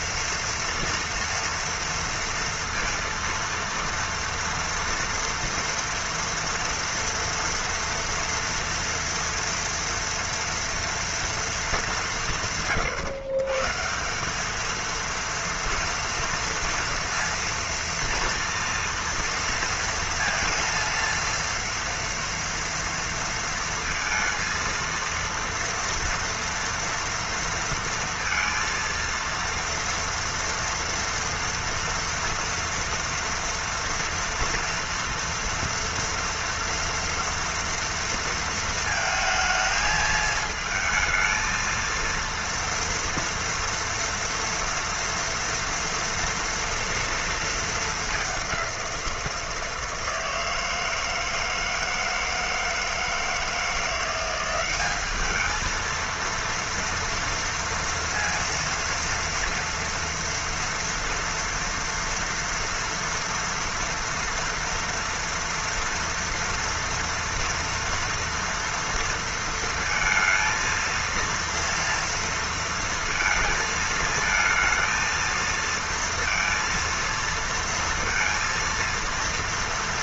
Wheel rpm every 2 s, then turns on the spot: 230, 230, 230, 230, 230, 240, 170, 190, 230, 230, 230, 230, 230, 230, 230, 230, 240, 230, 230, 230, 220, 230, 230, 230, 200, 160, 160, 180, 230, 230, 230, 240, 230, 230, 230, 230, 230, 220, 230, 230.
none